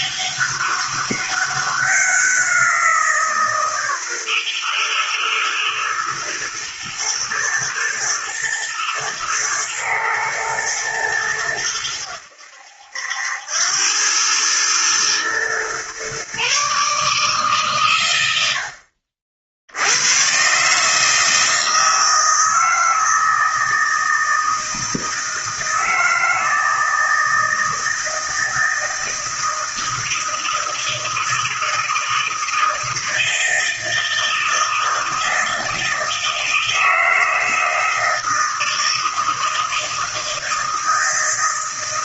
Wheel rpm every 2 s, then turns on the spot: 200, 180, 120, 120, 120, 110, 80, 110, 140, 80, 140, 160, 160, 160, 160, 160, 160, 160, 160, 160, 160.
none